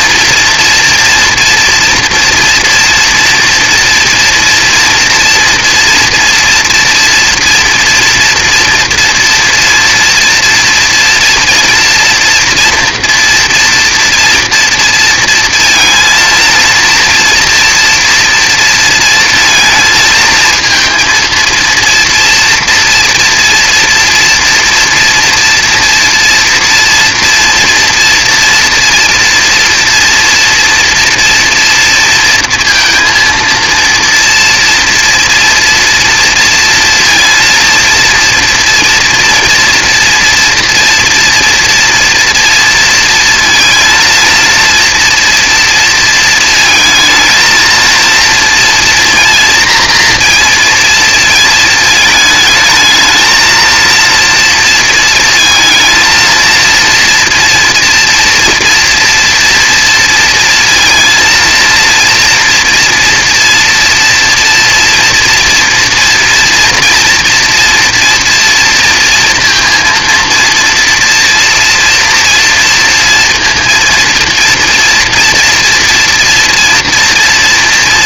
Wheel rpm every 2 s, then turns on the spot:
230, 240, 230, 240, 230, 230, 240, 230, 230, 230, 230, 230, 230, 230, 240, 230, 230, 230, 230, 230, 230, 230, 230, 230, 240, 230, 220, 230, 230, 230, 230, 230, 230, 230, 230, 230, 230, 230, 230.
none